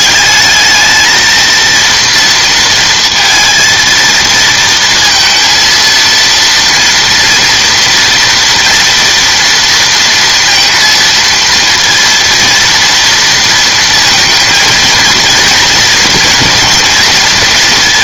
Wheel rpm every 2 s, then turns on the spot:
220, 230, 230, 230, 240, 230, 230, 230, 230.
none